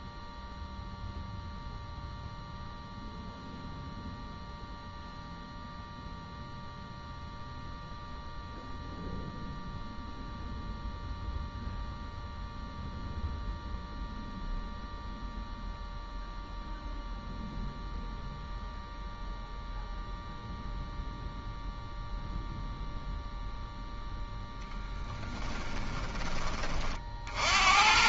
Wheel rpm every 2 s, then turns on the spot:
0, 0, 0, 0, 0, 0, 0, 0, 0, 0, 0, 0, 0, 20.
none